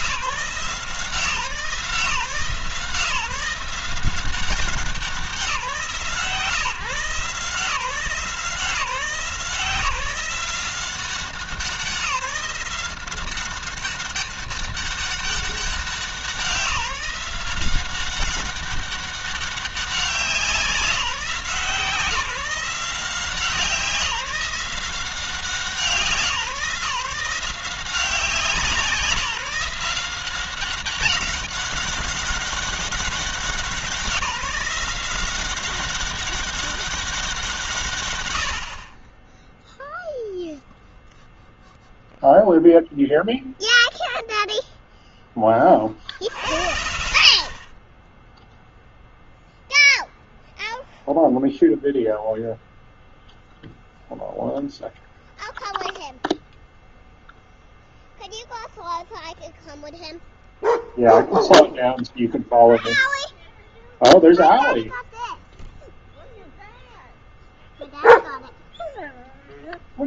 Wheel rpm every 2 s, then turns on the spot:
160, 150, 180, 150, 170, 180, 180, 200, 180, 200, 180, 180, 180, 160, 180, 190, 200, 190, 190, 30, 0, 0, 0, 60, 0, 0, 0, 0, 0, 0, 0, 0, 0, 0, 0.
none